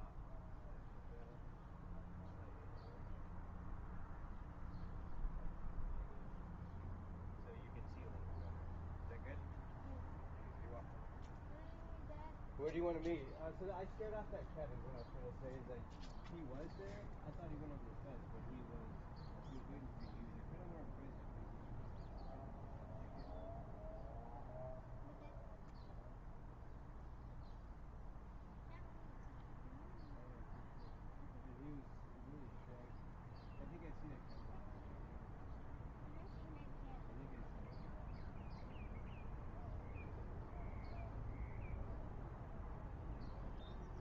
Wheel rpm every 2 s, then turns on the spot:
0, 0, 0, 0, 0, 0, 0, 0, 0, 0, 0, 0, 0, 0, 0, 0, 0, 0, 0, 0, 0, 0.
none